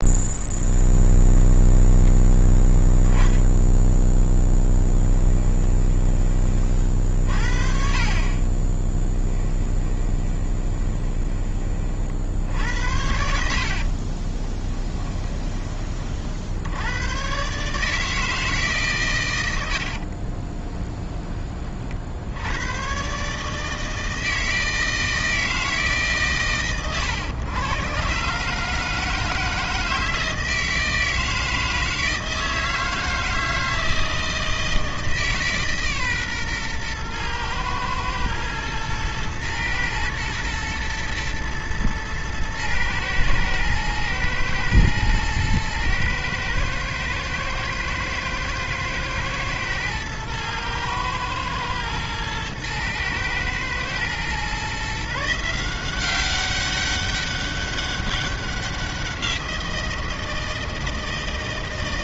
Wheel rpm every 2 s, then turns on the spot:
0, 0, 0, 40, 20, 20, 80, 20, 70, 150, 20, 100, 160, 120, 150, 160, 160, 160, 120, 110, 120, 110, 110, 110, 110, 110, 110, 140, 200, 190, 160.
8-12 14-16 20-22